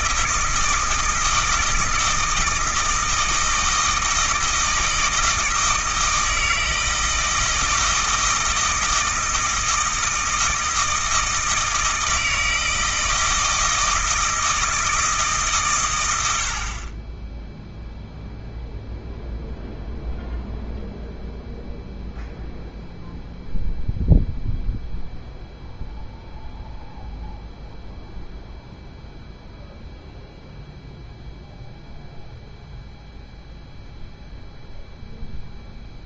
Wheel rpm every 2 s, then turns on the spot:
160, 160, 160, 160, 160, 160, 160, 160, 30, 0, 0, 0, 0, 0, 0, 0, 0, 0.
none